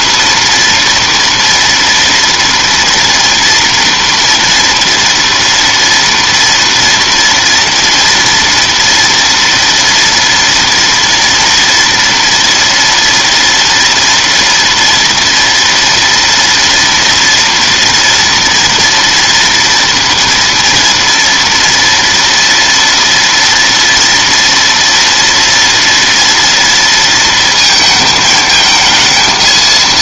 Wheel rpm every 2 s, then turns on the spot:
240, 230, 230, 230, 230, 230, 230, 230, 230, 230, 230, 230, 230, 230, 220.
none